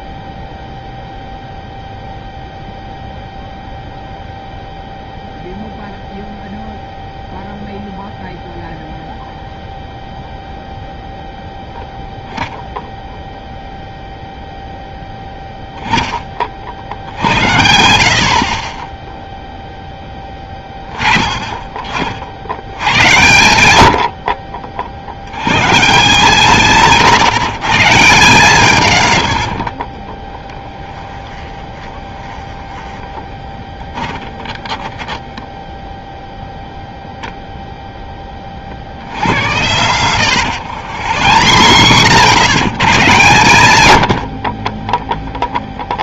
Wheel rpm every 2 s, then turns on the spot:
0, 0, 0, 0, 0, 0, 0, 0, 50, 40, 20, 80, 50, 150, 150, 10, 20, 20, 10, 50, 100, 120, 50.
30-36 40-42 44-46